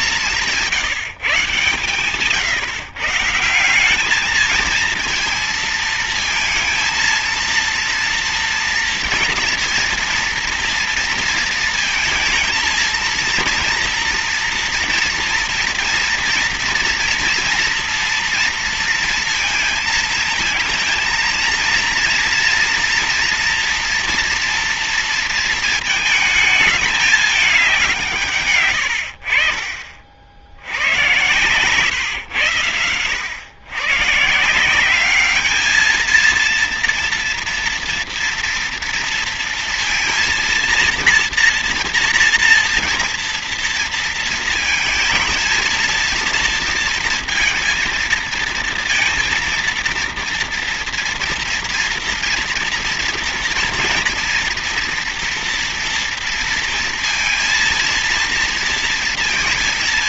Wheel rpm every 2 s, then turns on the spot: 160, 150, 220, 220, 230, 230, 230, 230, 230, 230, 230, 230, 230, 210, 110, 80, 110, 170, 230, 230, 230, 240, 220, 230, 230, 230, 230, 230, 230, 230.
none